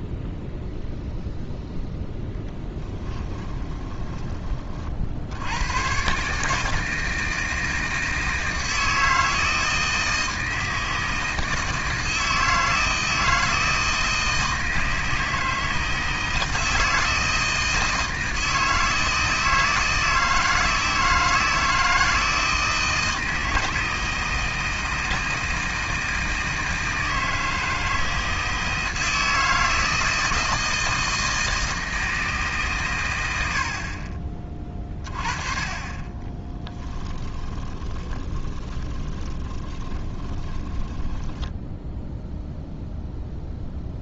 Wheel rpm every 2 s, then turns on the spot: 0, 20, 40, 160, 160, 160, 160, 160, 160, 160, 160, 160, 160, 160, 160, 160, 120, 20, 10, 20, 20, 0.
2-4 36-42